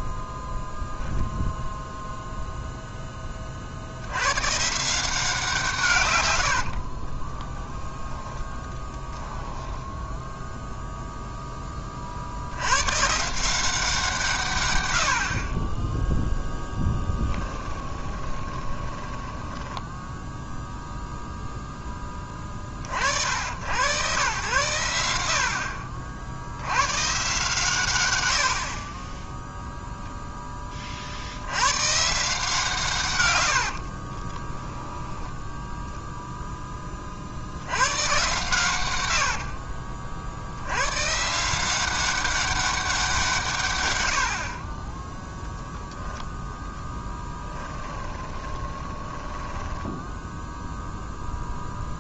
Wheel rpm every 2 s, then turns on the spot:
0, 0, 160, 60, 10, 0, 100, 100, 10, 20, 0, 30, 100, 120, 30, 20, 160, 10, 20, 110, 100, 190, 40, 10, 20, 0.
6-10 16-20 34-36 38-40 48-50